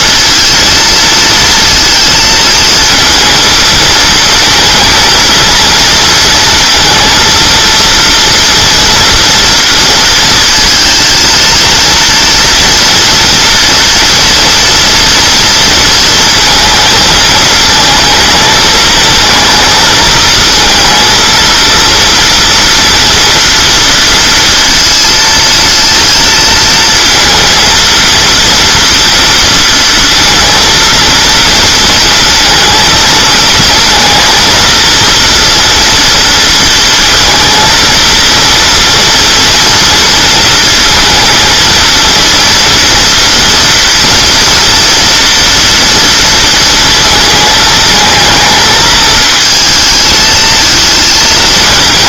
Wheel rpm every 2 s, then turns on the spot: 230, 230, 220, 230, 230, 230, 240, 240, 230, 220, 230, 240, 230, 230, 230, 230, 220, 230, 230, 230, 220, 230, 240, 230, 220, 220.
none